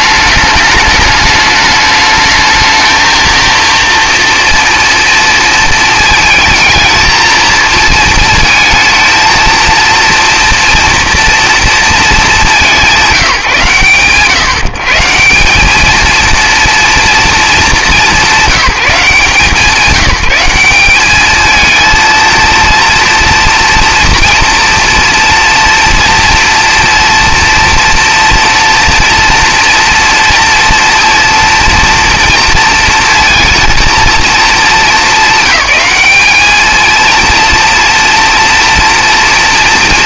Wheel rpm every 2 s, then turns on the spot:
210, 220, 230, 220, 220, 230, 180, 130, 230, 180, 190, 230, 230, 230, 240, 230, 230, 210, 220, 230.
none